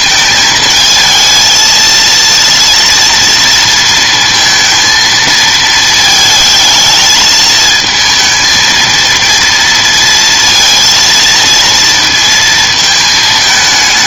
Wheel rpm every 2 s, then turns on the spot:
220, 230, 230, 220, 230, 230, 230.
none